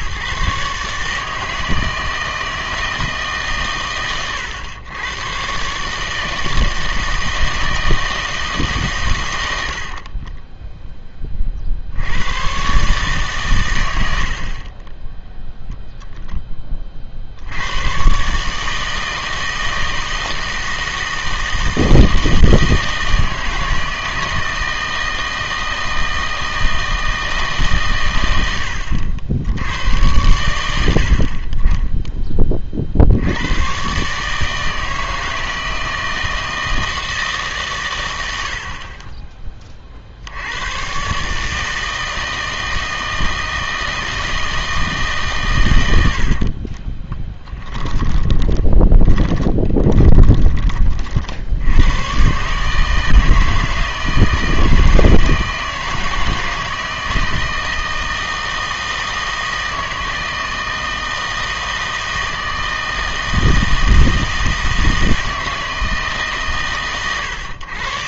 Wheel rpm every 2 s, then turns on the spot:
140, 160, 110, 160, 140, 10, 130, 40, 20, 150, 160, 160, 160, 160, 80, 80, 30, 160, 160, 60, 120, 160, 160, 40, 20, 30, 150, 160, 160, 160, 160, 160, 160, 130.
46-50